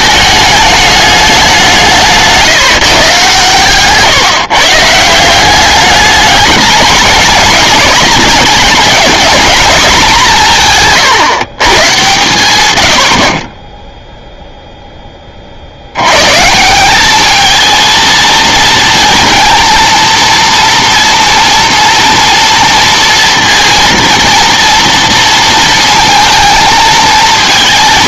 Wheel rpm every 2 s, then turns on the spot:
210, 140, 160, 210, 200, 150, 90, 10, 180, 230, 230, 230, 230, 220.
none